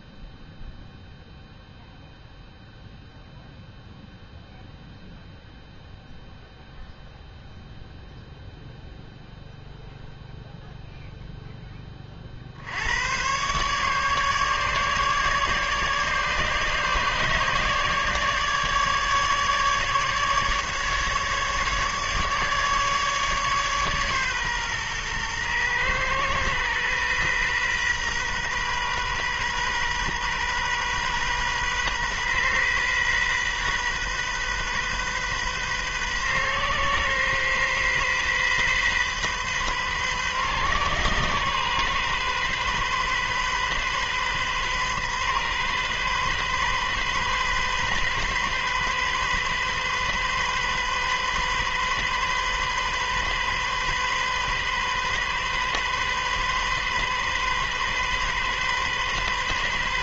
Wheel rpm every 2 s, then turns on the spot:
0, 0, 0, 0, 0, 0, 70, 150, 150, 150, 150, 150, 130, 120, 130, 130, 130, 130, 130, 130, 130, 130, 130, 130, 130, 130, 130, 130, 130, 130.
none